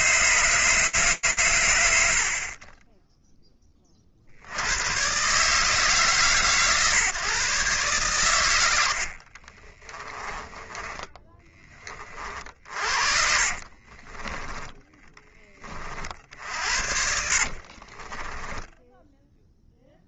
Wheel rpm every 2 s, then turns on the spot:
120, 20, 150, 140, 40, 20, 30, 40, 30, 0.
8-10 12-14 16-18